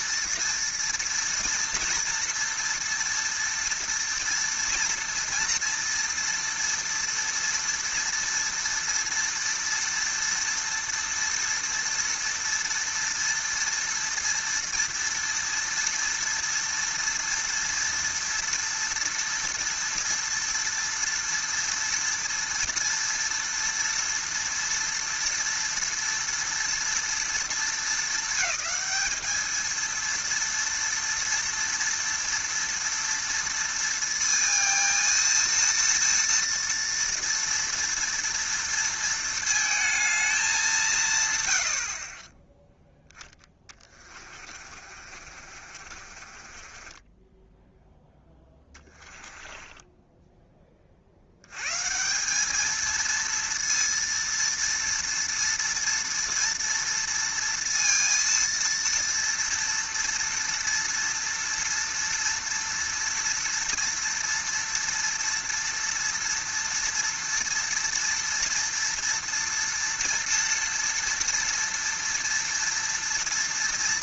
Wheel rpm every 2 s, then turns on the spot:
230, 230, 230, 230, 230, 230, 230, 230, 230, 230, 240, 230, 230, 230, 220, 230, 230, 230, 230, 230, 190, 10, 40, 30, 10, 20, 220, 230, 230, 230, 230, 230, 230, 230, 230, 230, 230.
44-50